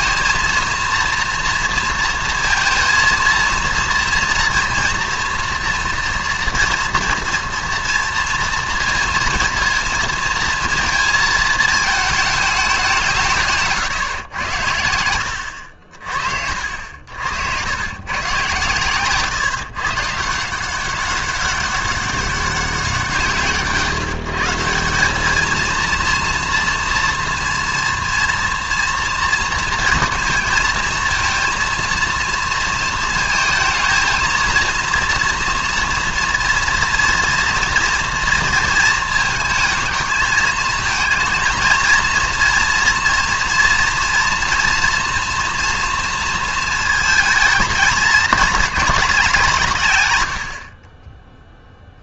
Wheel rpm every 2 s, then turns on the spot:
230, 230, 240, 230, 230, 230, 190, 90, 60, 120, 180, 180, 170, 230, 230, 230, 230, 230, 230, 230, 220, 230, 230, 220, 210, 40.
none